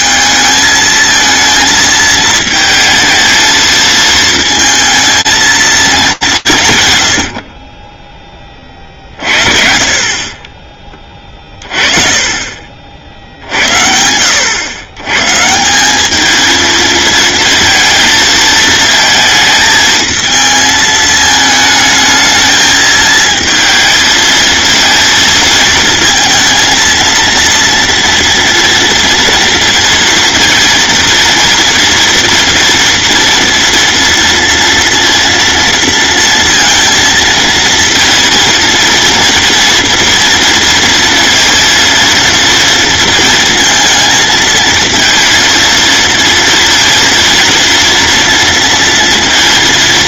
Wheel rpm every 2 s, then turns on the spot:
220, 220, 220, 140, 40, 20, 60, 130, 220, 220, 220, 220, 230, 230, 230, 230, 240, 230, 230, 230, 230, 230, 230, 230, 230.
none